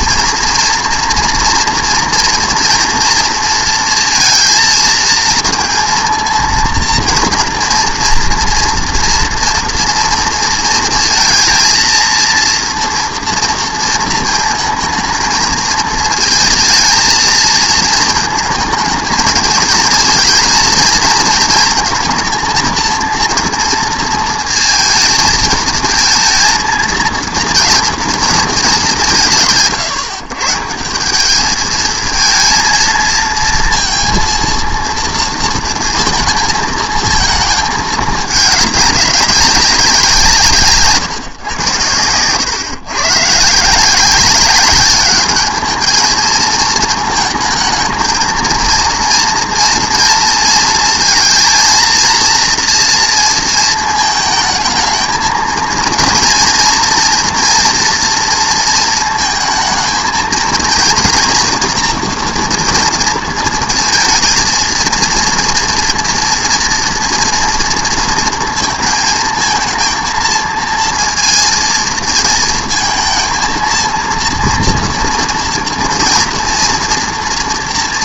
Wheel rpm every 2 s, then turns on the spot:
230, 240, 230, 230, 230, 230, 230, 220, 230, 220, 230, 230, 230, 230, 220, 160, 220, 230, 220, 210, 160, 120, 200, 220, 230, 230, 230, 220, 230, 230, 230, 230, 230, 230, 230, 230, 220, 230, 230.
none